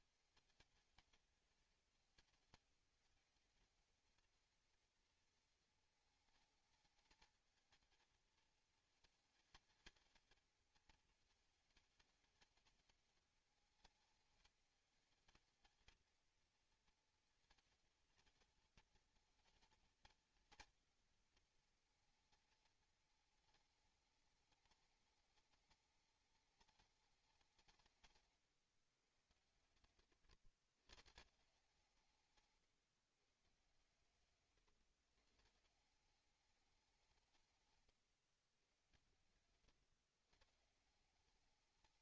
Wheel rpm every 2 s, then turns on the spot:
220, 220, 230, 220, 220, 220, 210, 210, 230, 230, 230, 230, 210, 210, 130, 110, 140, 140, 200, 120, 160.
none